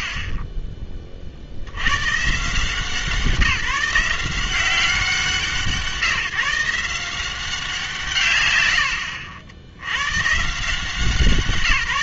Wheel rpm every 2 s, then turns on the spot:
30, 150, 180, 170, 110, 160.
0-2